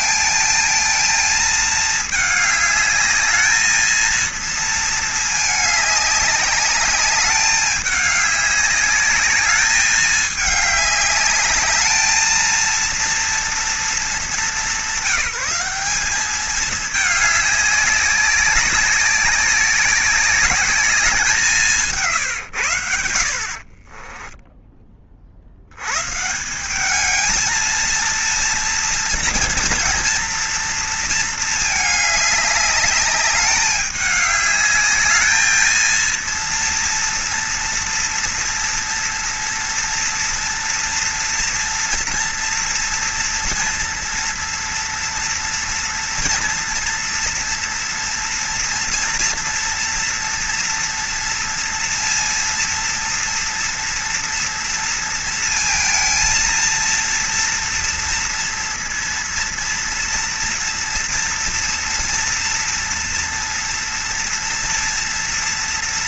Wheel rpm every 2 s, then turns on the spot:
220, 210, 230, 200, 200, 210, 230, 190, 210, 190, 200, 110, 10, 190, 230, 230, 210, 210, 230, 240, 230, 230, 230, 230, 230, 240, 230, 230, 230, 230, 240, 230, 230.
none